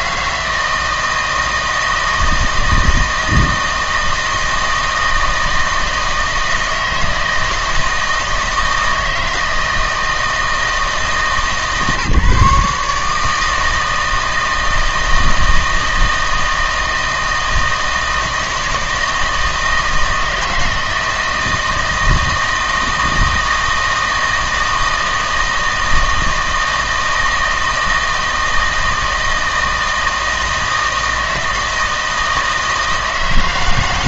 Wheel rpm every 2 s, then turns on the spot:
160, 160, 160, 160, 160, 160, 150, 160, 160, 160, 160, 160, 160, 160, 160, 160, 160.
none